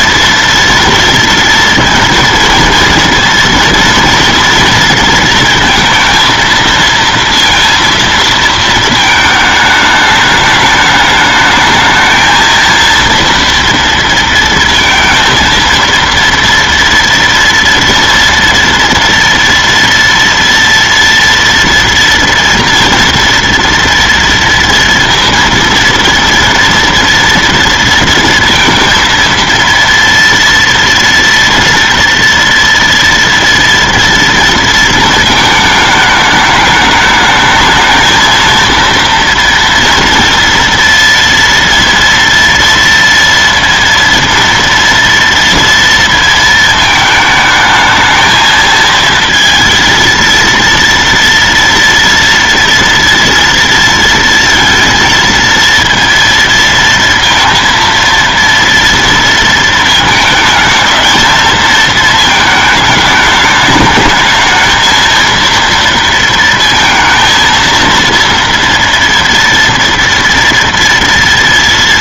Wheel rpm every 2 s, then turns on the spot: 230, 230, 230, 230, 220, 210, 230, 230, 230, 230, 230, 230, 230, 230, 230, 230, 230, 230, 210, 230, 230, 230, 230, 220, 220, 230, 230, 230, 230, 230, 220, 220, 220, 230, 230, 230.
none